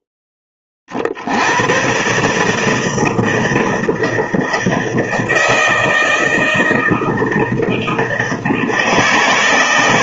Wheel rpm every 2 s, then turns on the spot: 50, 160, 160, 160, 160.
none